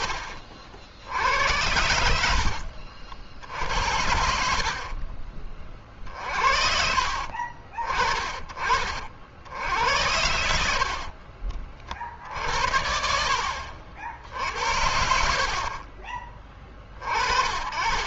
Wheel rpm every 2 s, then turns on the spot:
60, 60, 50, 60, 50, 50, 60, 50, 40.
4-6 10-12